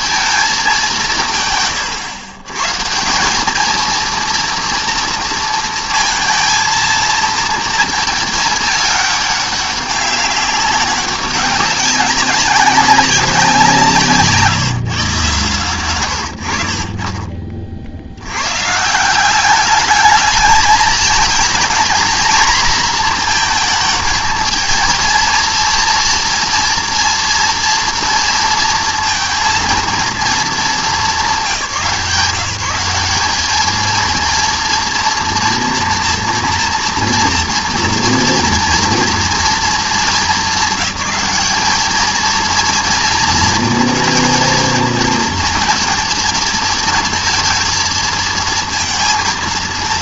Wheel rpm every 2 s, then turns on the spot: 190, 150, 230, 220, 210, 200, 190, 150, 40, 140, 220, 230, 230, 230, 230, 190, 190, 230, 240, 230, 200, 230, 230, 220, 230.
none